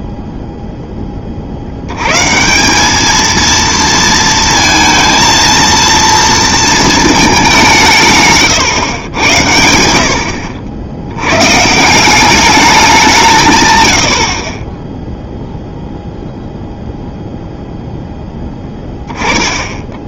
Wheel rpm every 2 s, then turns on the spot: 0, 170, 230, 230, 120, 70, 200, 20, 0, 10.
none